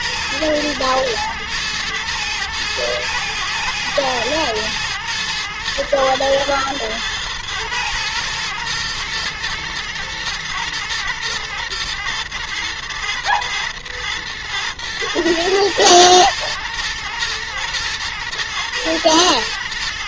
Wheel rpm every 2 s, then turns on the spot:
110, 110, 110, 110, 120, 120, 110, 120, 120, 110.
none